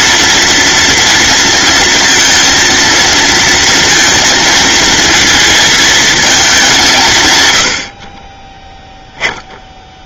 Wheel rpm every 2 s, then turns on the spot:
230, 230, 230, 180, 0.
none